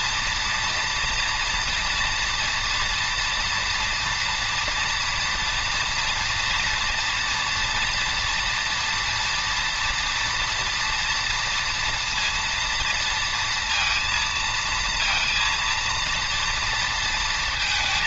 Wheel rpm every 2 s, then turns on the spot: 230, 230, 230, 240, 230, 230, 230, 230, 230.
none